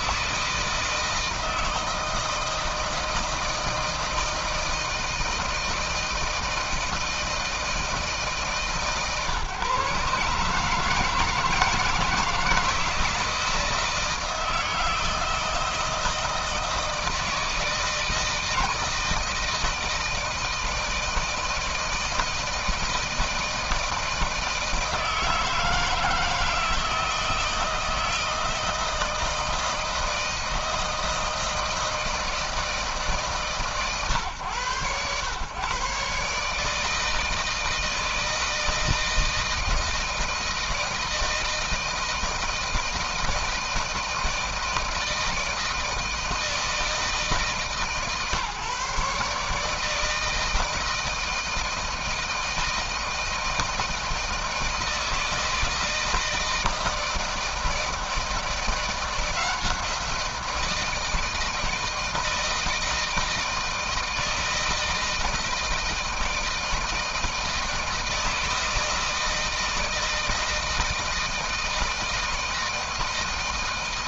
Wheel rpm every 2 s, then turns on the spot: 160, 160, 160, 160, 150, 150, 160, 160, 160, 160, 160, 160, 170, 160, 160, 160, 160, 120, 150, 160, 160, 160, 160, 160, 140, 160, 160, 160, 160, 170, 170, 160, 160, 160, 160, 160, 160.
none